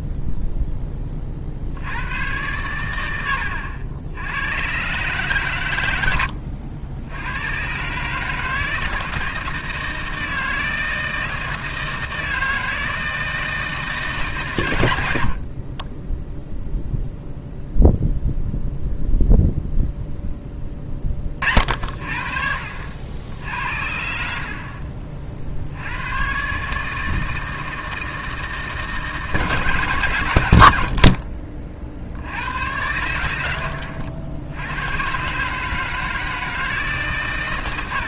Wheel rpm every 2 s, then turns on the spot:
0, 90, 90, 90, 160, 160, 160, 120, 0, 0, 20, 70, 50, 140, 150, 80, 90, 100, 150.
none